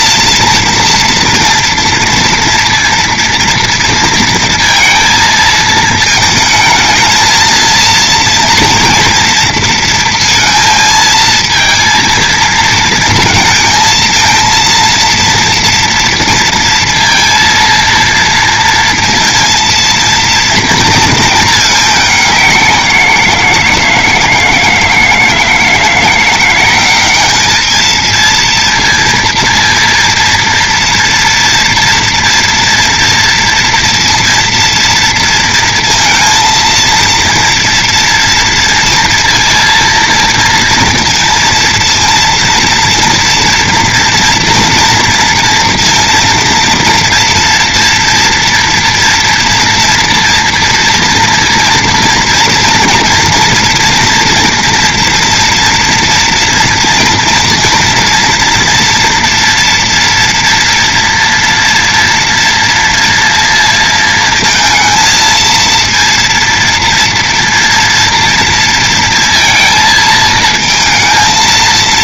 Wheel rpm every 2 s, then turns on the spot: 230, 230, 230, 220, 230, 230, 230, 230, 230, 230, 230, 180, 160, 180, 230, 230, 240, 230, 230, 230, 230, 230, 230, 230, 230, 230, 230, 230, 240, 230, 230, 230, 220, 230, 230, 230.
none